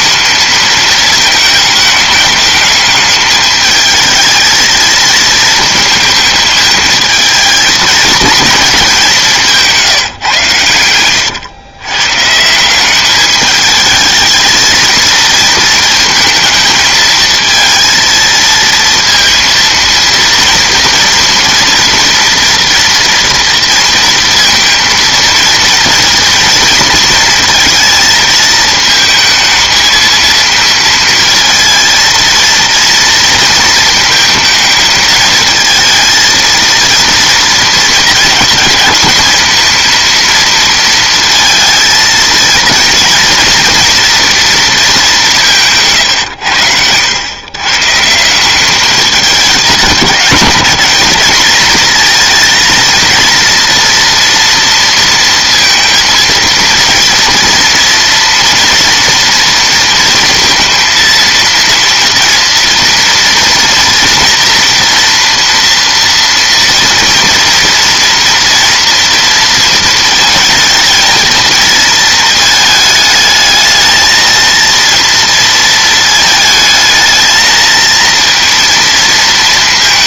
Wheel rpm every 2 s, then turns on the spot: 220, 210, 220, 220, 210, 110, 180, 220, 220, 230, 230, 240, 230, 230, 220, 230, 230, 220, 230, 230, 230, 230, 230, 100, 190, 210, 230, 230, 230, 230, 230, 230, 230, 230, 240, 230, 220, 230, 220, 230.
none